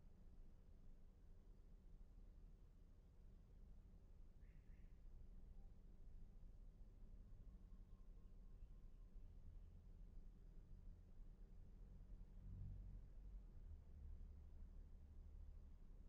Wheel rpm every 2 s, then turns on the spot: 0, 0, 0, 0, 0, 0, 0, 0.
none